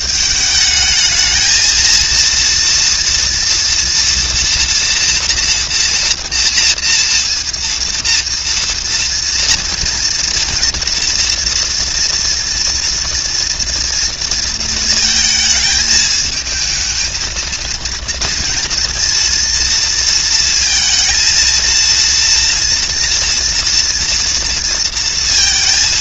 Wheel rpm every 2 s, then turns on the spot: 220, 230, 230, 230, 230, 230, 230, 220, 220, 230, 230, 240, 230.
none